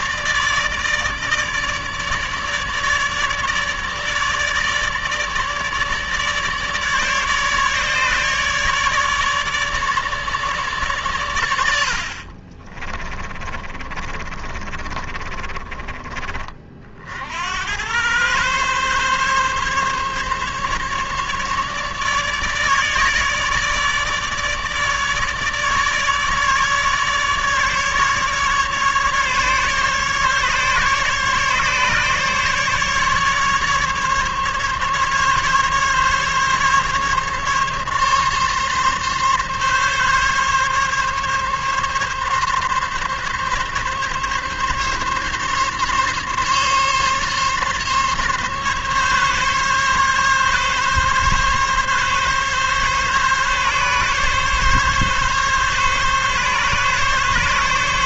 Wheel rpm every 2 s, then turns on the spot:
150, 150, 150, 150, 150, 130, 30, 30, 60, 140, 150, 150, 150, 150, 150, 150, 150, 140, 140, 140, 140, 140, 140, 140, 140, 140, 140, 140, 140.
12-16